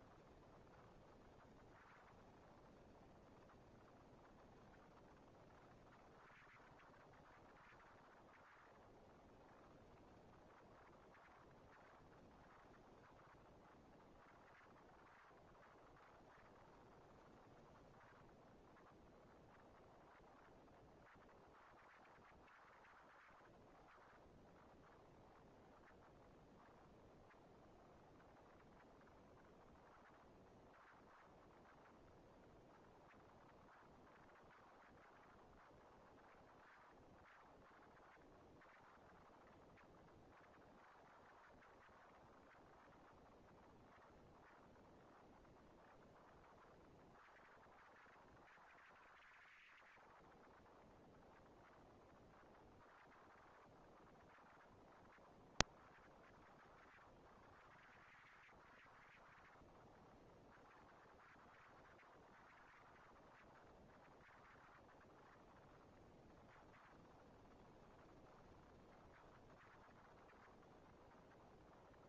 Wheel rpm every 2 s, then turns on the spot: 230, 220, 230, 230, 230, 240, 230, 230, 230, 230, 240, 230, 230, 230, 220, 220, 210, 160, 160, 210, 230, 230, 230, 230, 230, 230, 230, 230, 230, 230, 230, 230, 230, 210, 200, 200.
none